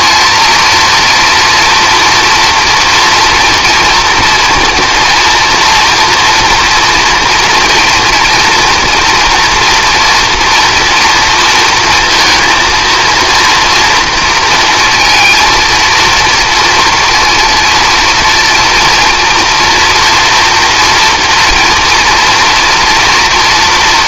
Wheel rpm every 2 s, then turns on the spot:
230, 230, 230, 240, 230, 230, 230, 230, 230, 230, 230, 230.
none